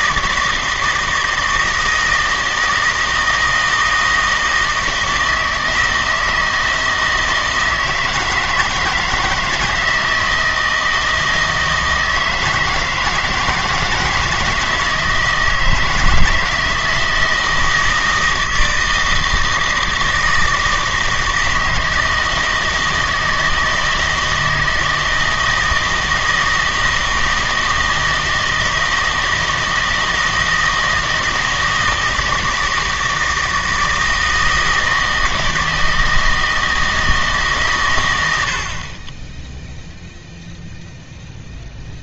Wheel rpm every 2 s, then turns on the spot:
160, 160, 160, 160, 160, 160, 160, 160, 160, 160, 160, 160, 160, 160, 160, 160, 160, 160, 160, 120, 0.
none